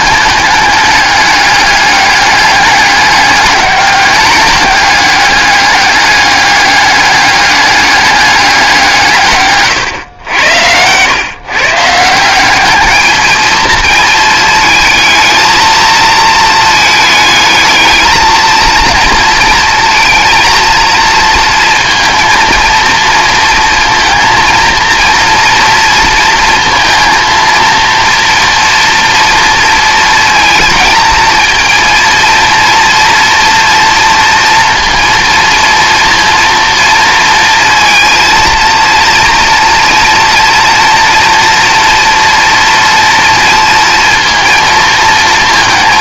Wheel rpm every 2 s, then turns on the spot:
210, 200, 200, 200, 170, 100, 210, 220, 220, 230, 230, 230, 230, 230, 230, 230, 230, 230, 230, 230, 230, 240, 230.
none